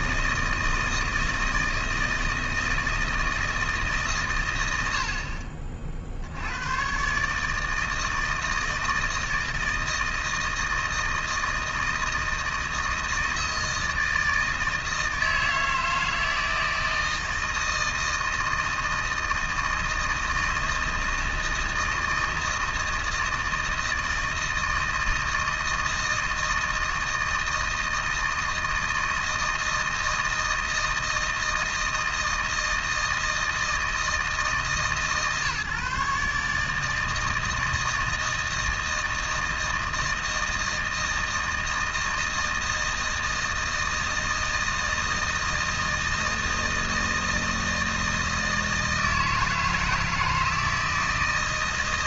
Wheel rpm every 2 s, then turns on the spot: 160, 160, 70, 130, 160, 160, 160, 160, 160, 160, 160, 160, 160, 160, 160, 160, 160, 150, 160, 160, 160, 160, 160, 160, 160, 160.
none